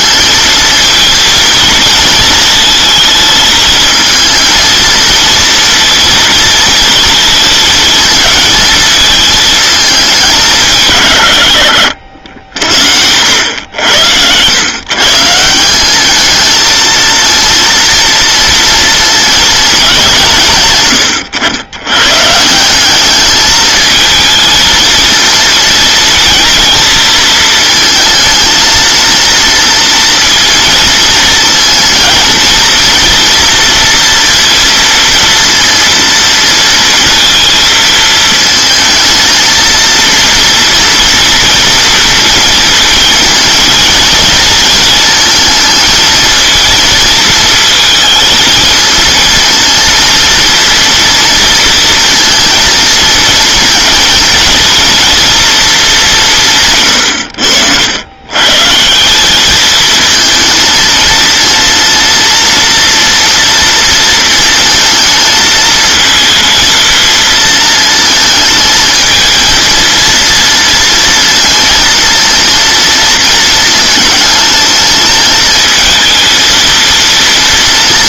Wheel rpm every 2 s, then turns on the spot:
230, 220, 230, 230, 220, 180, 70, 110, 220, 230, 130, 160, 220, 220, 230, 230, 230, 230, 230, 230, 230, 230, 220, 230, 220, 230, 230, 230, 160, 140, 230, 230, 220, 230, 220, 230, 230, 220, 230.
none